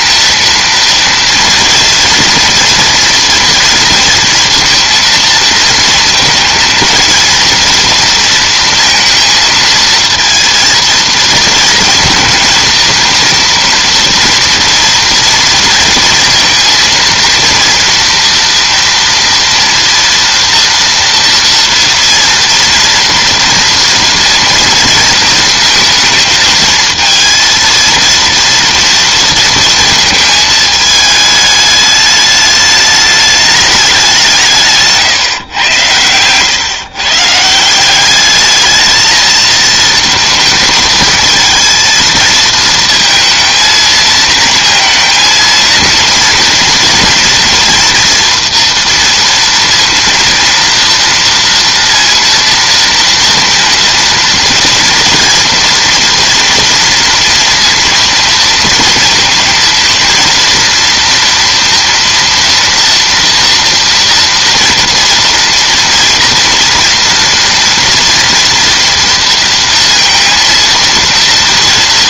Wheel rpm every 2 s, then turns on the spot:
230, 230, 230, 230, 230, 230, 230, 230, 230, 230, 230, 230, 230, 230, 230, 210, 210, 140, 140, 220, 220, 230, 230, 230, 230, 230, 230, 230, 230, 230, 240, 240, 230, 230, 230, 230.
none